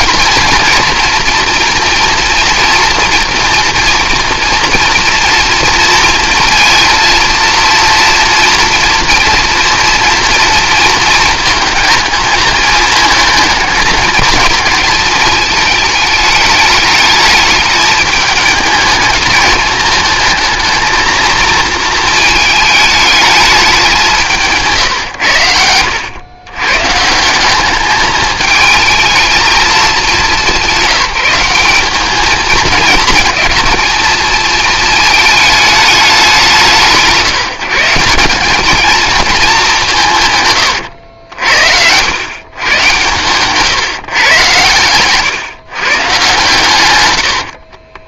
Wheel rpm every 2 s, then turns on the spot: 230, 230, 230, 230, 230, 230, 220, 220, 210, 210, 220, 220, 120, 150, 220, 200, 220, 220, 170, 220, 110, 130, 110, 120.
40-42 44-46